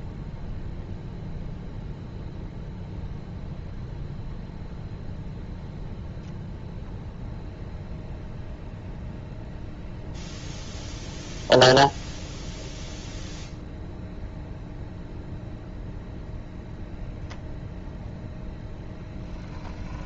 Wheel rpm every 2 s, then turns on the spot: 0, 0, 0, 0, 0, 0, 0, 0, 0, 10.
none